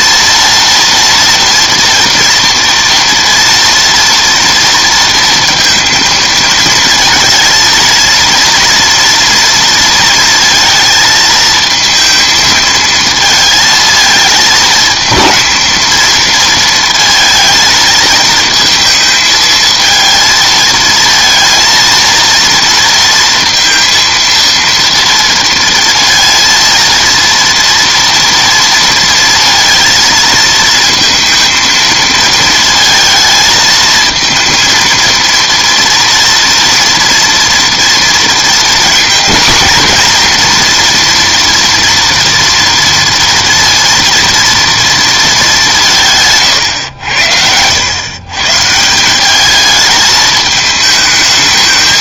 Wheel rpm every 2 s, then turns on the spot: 230, 230, 230, 220, 230, 230, 220, 220, 230, 220, 230, 230, 230, 230, 230, 220, 220, 230, 230, 230, 240, 230, 230, 130, 160, 220.
none